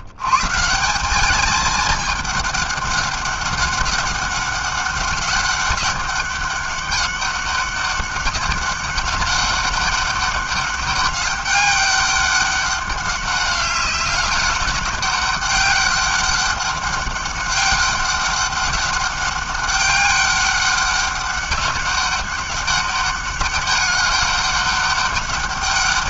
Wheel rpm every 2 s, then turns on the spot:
150, 210, 200, 200, 200, 200, 200, 200, 200, 200, 200, 200, 200.
none